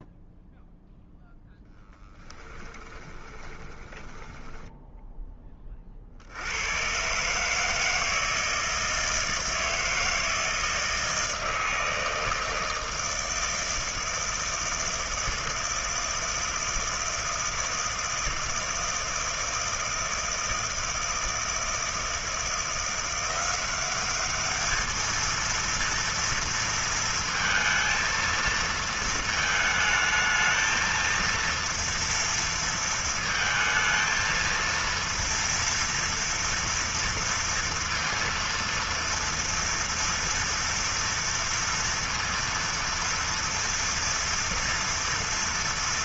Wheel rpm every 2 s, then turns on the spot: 0, 10, 10, 70, 160, 160, 160, 160, 160, 160, 160, 170, 200, 230, 230, 220, 230, 230, 230, 230, 230, 230, 230.
2-6